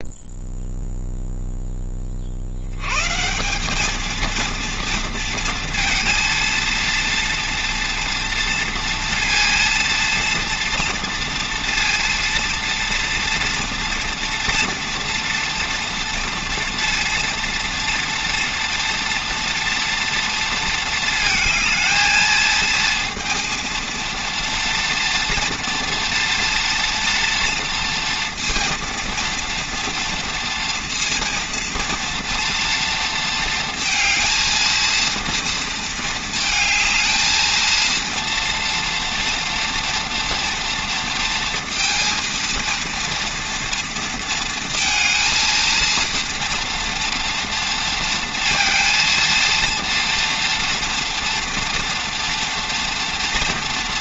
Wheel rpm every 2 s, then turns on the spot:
0, 110, 230, 230, 230, 230, 230, 230, 240, 240, 230, 230, 230, 230, 230, 230, 230, 230, 220, 230, 230, 230, 230, 230, 230, 230, 230.
none